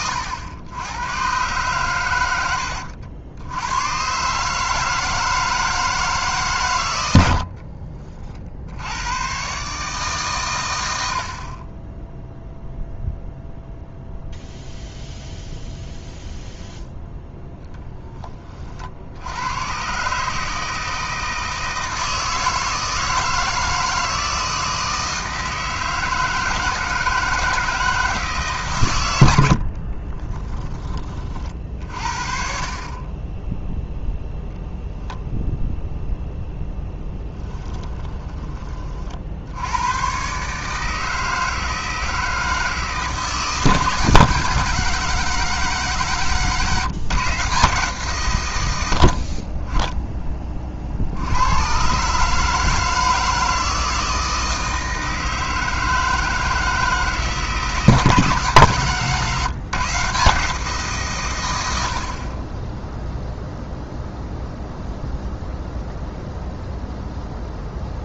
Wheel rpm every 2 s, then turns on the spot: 90, 90, 150, 130, 60, 120, 0, 0, 0, 40, 160, 160, 160, 160, 140, 20, 40, 0, 0, 30, 140, 160, 160, 140, 110, 30, 150, 160, 160, 140, 160, 10, 0, 0.
none